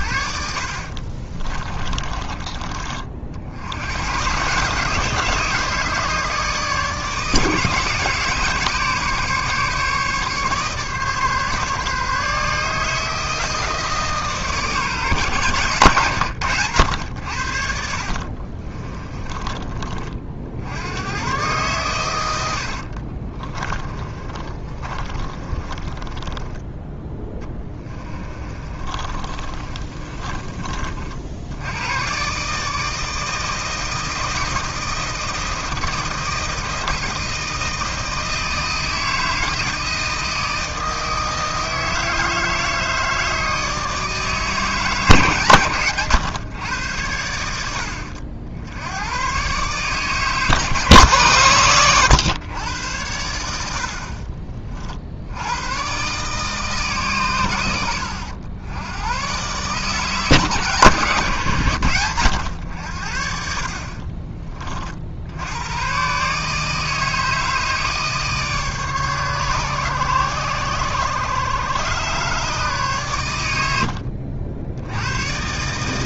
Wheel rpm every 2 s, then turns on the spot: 50, 40, 150, 160, 150, 140, 160, 150, 100, 30, 90, 50, 30, 10, 30, 50, 160, 160, 160, 160, 160, 160, 150, 100, 100, 140, 100, 50, 140, 100, 140, 80, 50, 160, 140, 120, 130, 100.
0-2 18-20 22-26 28-30